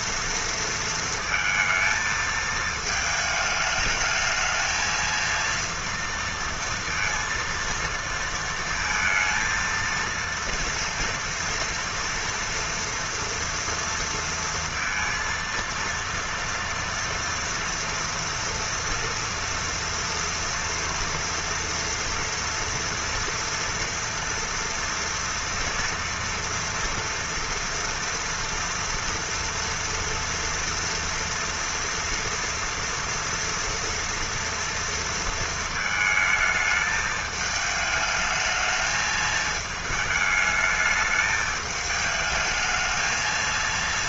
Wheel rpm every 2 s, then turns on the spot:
230, 220, 220, 230, 230, 230, 230, 230, 230, 230, 230, 230, 230, 230, 230, 230, 230, 230, 220, 220, 220, 220.
none